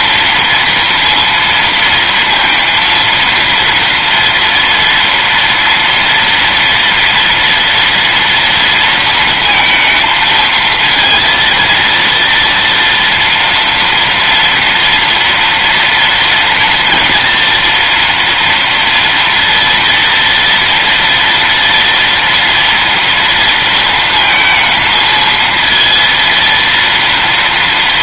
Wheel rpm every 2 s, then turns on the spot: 230, 230, 230, 230, 230, 230, 230, 230, 240, 230, 230, 230, 230, 230.
none